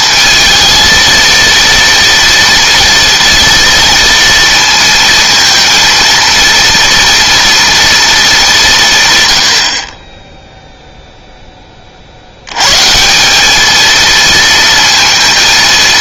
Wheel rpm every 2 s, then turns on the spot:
230, 230, 230, 230, 160, 0, 150, 230.
none